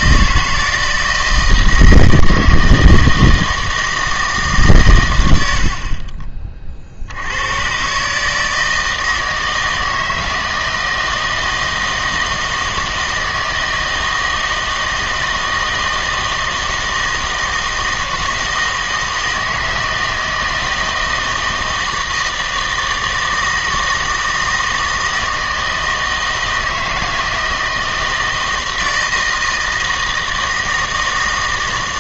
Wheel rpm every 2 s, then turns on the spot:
160, 160, 140, 30, 160, 160, 160, 160, 160, 160, 160, 160, 160, 160, 160, 160.
none